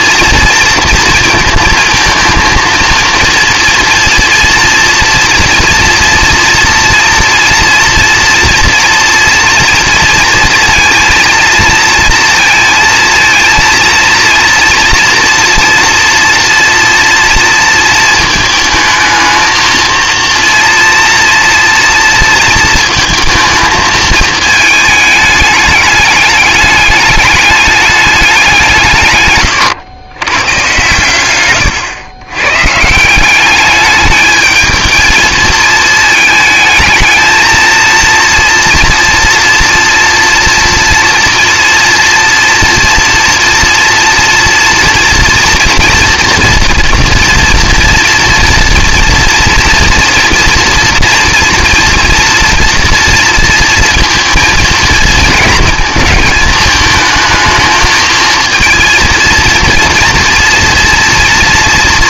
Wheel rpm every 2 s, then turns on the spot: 230, 230, 230, 230, 230, 230, 230, 230, 230, 220, 230, 230, 220, 210, 170, 120, 140, 220, 220, 230, 230, 230, 240, 230, 230, 230, 230, 220, 220, 230, 230.
none